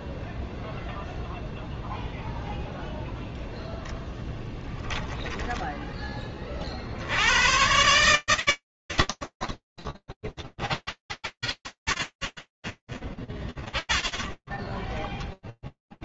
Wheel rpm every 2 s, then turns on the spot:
0, 0, 10, 40, 70, 10, 0, 10.
10-12